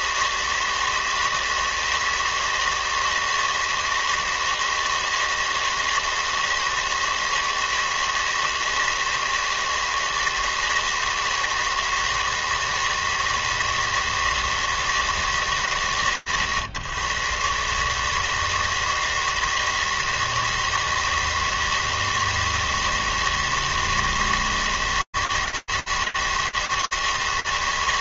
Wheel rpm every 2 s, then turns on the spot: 160, 160, 160, 160, 160, 160, 160, 140, 120, 160, 160, 160, 160, 160.
none